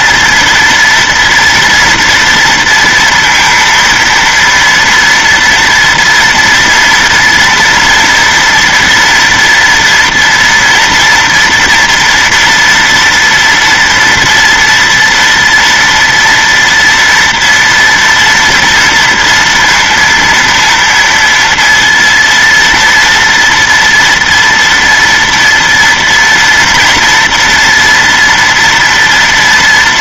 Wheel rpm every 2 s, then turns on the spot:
230, 230, 230, 240, 230, 230, 230, 230, 230, 230, 230, 230, 230, 230, 230.
none